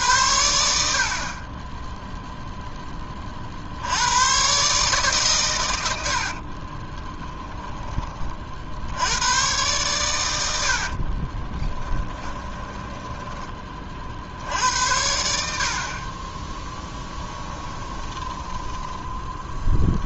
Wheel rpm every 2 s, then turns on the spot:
70, 10, 140, 60, 70, 70, 10, 70, 10, 20.
6-8 10-14 16-20